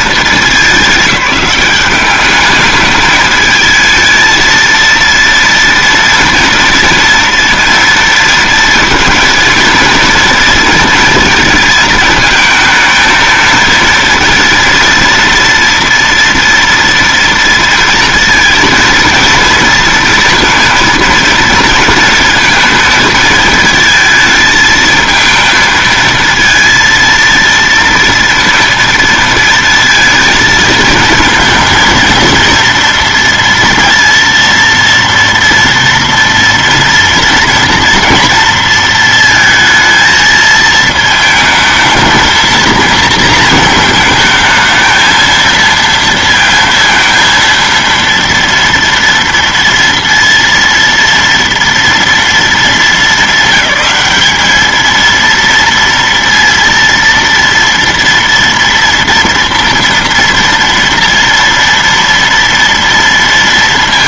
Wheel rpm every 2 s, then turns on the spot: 210, 210, 230, 230, 230, 230, 220, 230, 230, 230, 230, 230, 220, 230, 230, 230, 230, 230, 240, 230, 220, 230, 220, 230, 230, 230, 220, 220, 230, 230, 230, 230.
none